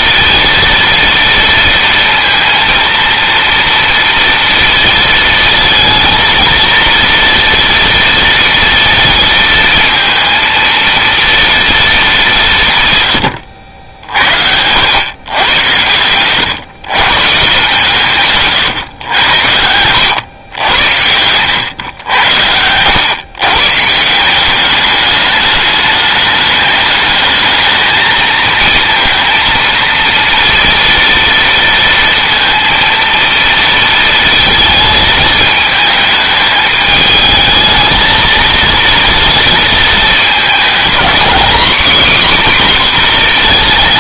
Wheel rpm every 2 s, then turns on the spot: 230, 230, 230, 230, 230, 230, 130, 110, 130, 120, 90, 110, 210, 210, 230, 230, 230, 220, 220, 230, 230, 250.
none